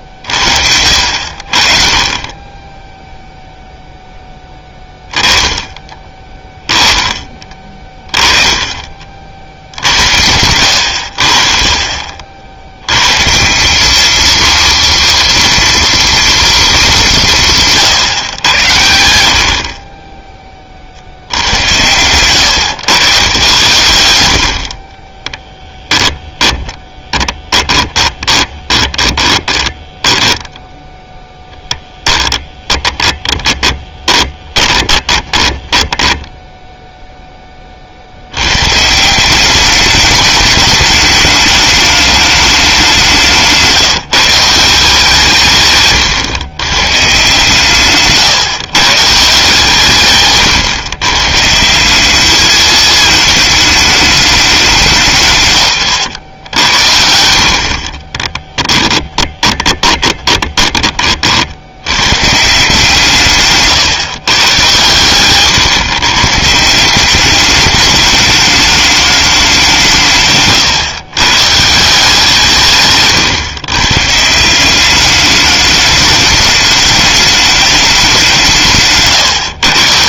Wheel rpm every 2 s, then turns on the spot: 70, 10, 10, 10, 20, 90, 90, 230, 210, 90, 50, 120, 60, 10, 20, 0, 20, 20, 0, 140, 210, 200, 170, 140, 150, 130, 220, 170, 80, 10, 20, 150, 120, 180, 210, 130, 150, 200, 210, 170.
26-30 32-36 58-60